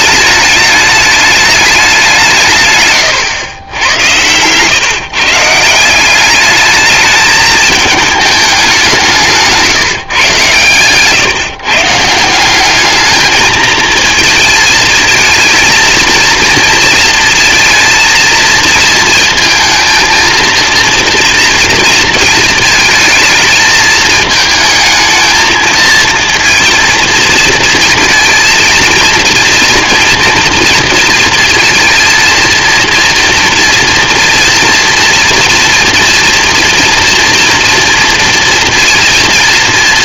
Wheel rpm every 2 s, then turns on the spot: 210, 140, 130, 200, 200, 120, 190, 220, 230, 230, 230, 220, 220, 230, 230, 230, 230, 230, 230, 230.
2-4